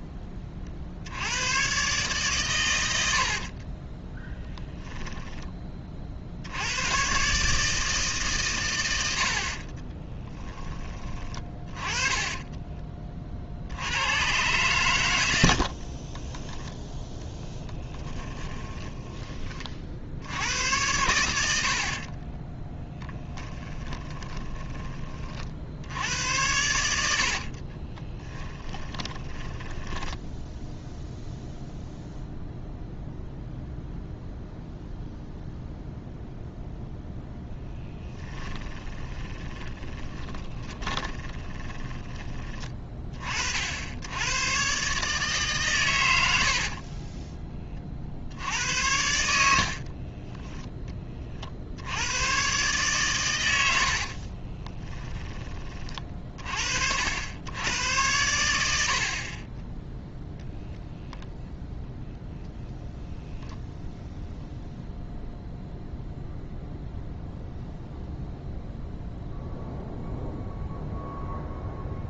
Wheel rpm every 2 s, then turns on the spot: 30, 100, 10, 100, 100, 20, 30, 110, 10, 20, 90, 10, 20, 90, 10, 0, 0, 0, 0, 10, 20, 30, 130, 40, 80, 10, 130, 20, 60, 70, 0, 0, 0, 0, 0, 0.
4-6 16-20 22-24 28-30 38-42 46-48 54-56 58-60